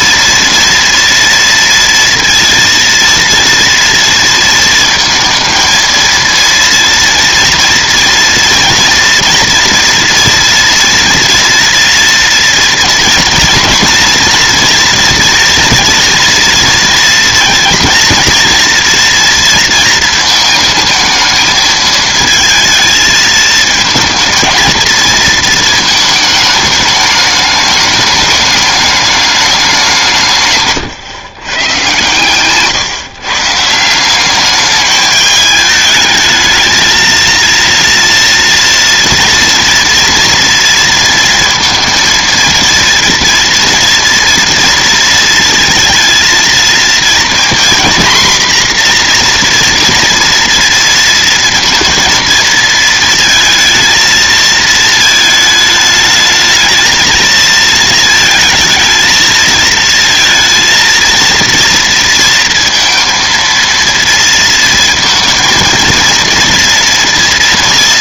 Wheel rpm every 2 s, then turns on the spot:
230, 230, 230, 230, 230, 230, 230, 230, 230, 230, 220, 220, 230, 220, 210, 140, 130, 200, 220, 230, 230, 230, 230, 230, 250, 230, 220, 220, 220, 220, 230, 230, 230, 230.
none